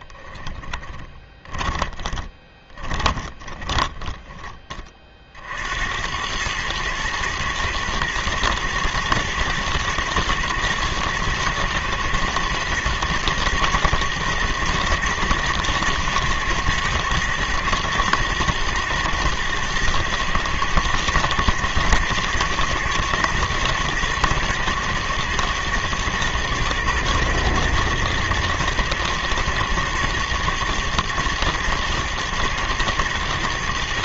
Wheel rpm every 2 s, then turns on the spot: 10, 20, 20, 110, 120, 120, 120, 120, 110, 110, 110, 120, 110, 120, 110, 120, 110.
0-4